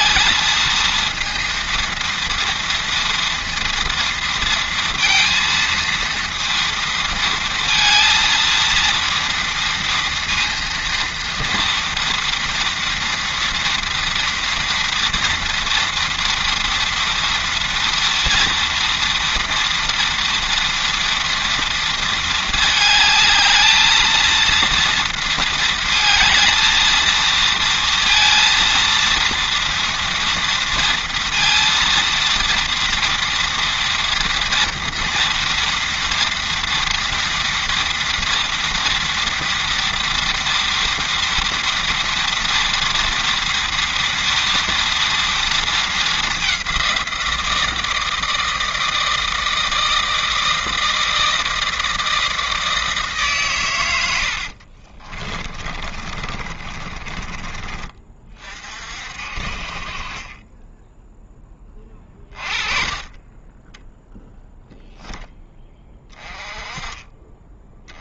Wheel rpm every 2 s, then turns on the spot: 230, 230, 230, 230, 230, 230, 230, 230, 230, 230, 230, 220, 230, 230, 230, 230, 230, 230, 230, 230, 230, 230, 240, 190, 160, 160, 160, 60, 30, 40, 10, 30, 0, 20.
54-58